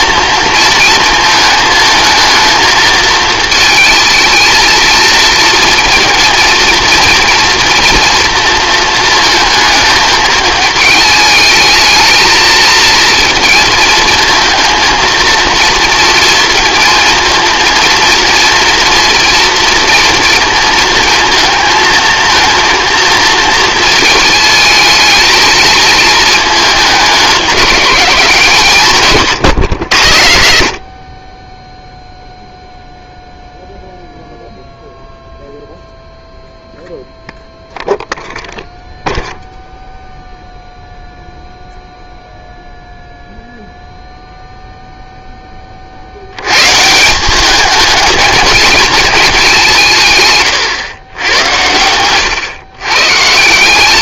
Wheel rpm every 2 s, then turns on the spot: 230, 220, 230, 230, 230, 220, 230, 220, 230, 230, 220, 230, 220, 220, 170, 70, 0, 0, 0, 0, 0, 0, 0, 130, 220, 120, 120.
none